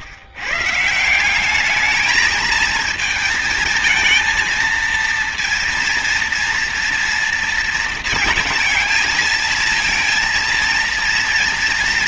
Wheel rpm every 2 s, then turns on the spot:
140, 220, 230, 230, 220, 230.
none